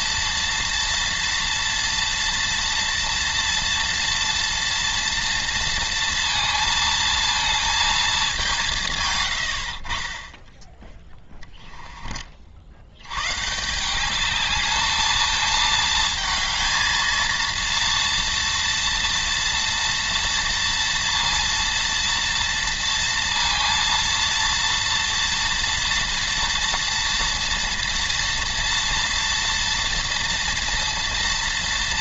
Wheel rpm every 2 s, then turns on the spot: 230, 230, 230, 230, 170, 10, 70, 210, 220, 230, 230, 230, 230, 230, 230, 240.
none